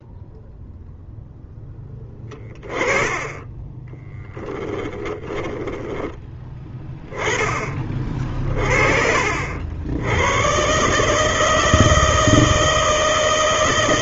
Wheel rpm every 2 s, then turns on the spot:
0, 20, 10, 10, 50, 150, 160.
4-6